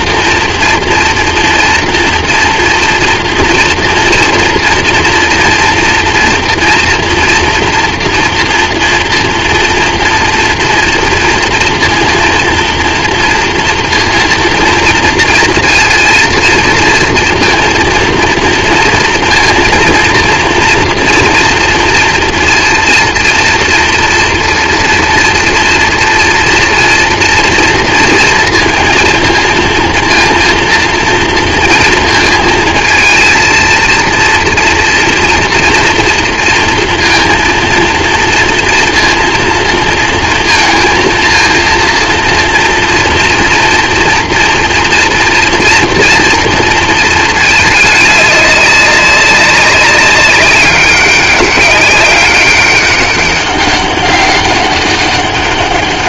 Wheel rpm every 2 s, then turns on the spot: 230, 230, 240, 230, 230, 230, 230, 230, 230, 230, 230, 230, 230, 230, 230, 230, 230, 240, 240, 240, 230, 230, 230, 230, 200, 200, 190, 200.
none